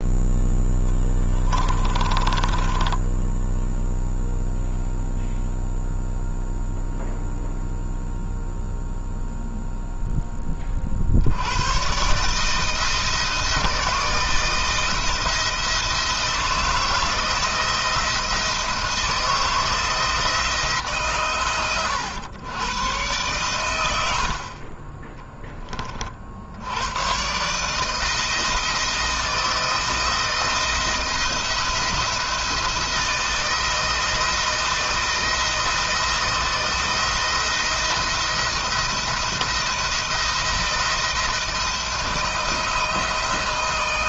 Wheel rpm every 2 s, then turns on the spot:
10, 10, 0, 0, 0, 50, 160, 160, 160, 170, 150, 110, 20, 110, 160, 160, 170, 170, 170, 170, 170, 160.
0-4